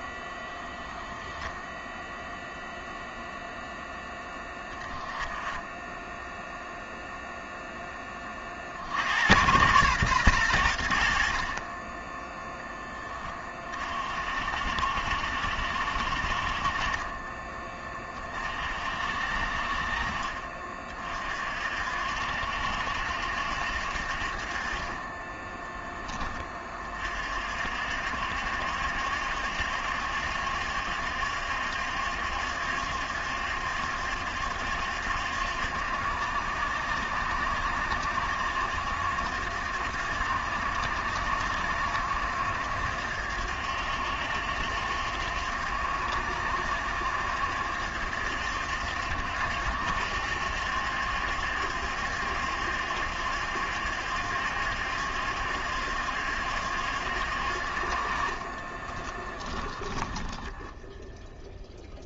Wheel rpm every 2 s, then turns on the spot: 0, 0, 10, 0, 60, 80, 20, 60, 30, 50, 40, 70, 30, 40, 70, 70, 70, 70, 70, 70, 70, 70, 70, 70, 70, 70, 70, 70, 70, 20, 0.
58-60